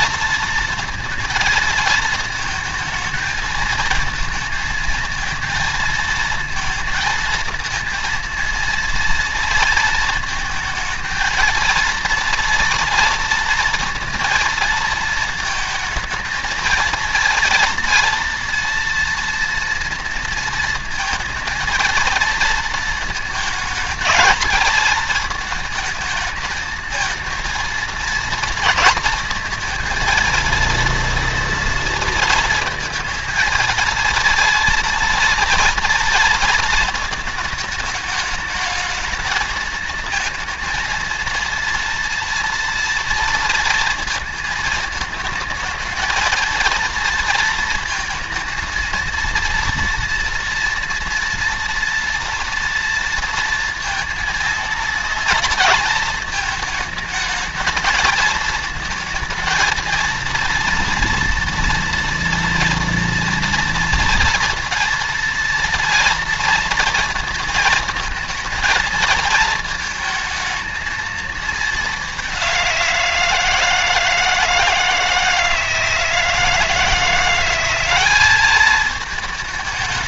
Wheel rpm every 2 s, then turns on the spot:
230, 220, 230, 230, 230, 220, 230, 230, 220, 230, 230, 230, 220, 220, 230, 230, 230, 230, 230, 220, 230, 230, 220, 220, 230, 230, 230, 230, 220, 220, 230, 230, 230, 230, 230, 220, 180, 160, 160, 210.
none